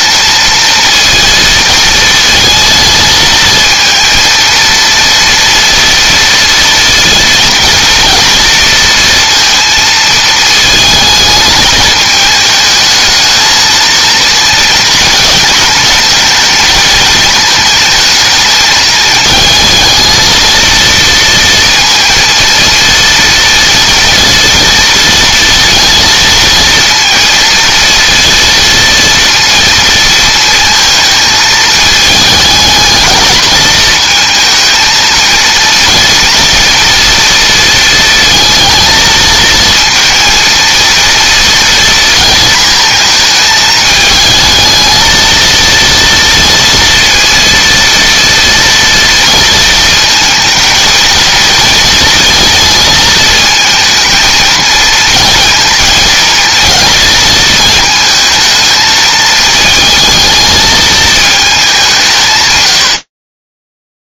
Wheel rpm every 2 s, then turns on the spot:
220, 230, 230, 230, 230, 220, 220, 220, 220, 220, 230, 230, 230, 230, 230, 220, 220, 230, 230, 220, 230, 230, 220, 230, 230, 230, 230, 220, 220, 220, 220, 110.
none